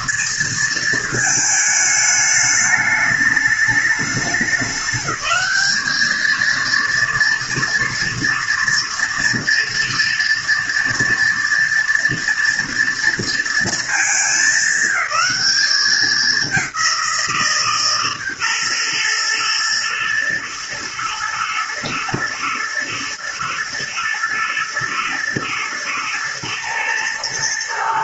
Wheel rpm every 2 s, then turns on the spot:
230, 210, 200, 230, 230, 230, 230, 200, 190, 130, 110, 120, 110, 120.
none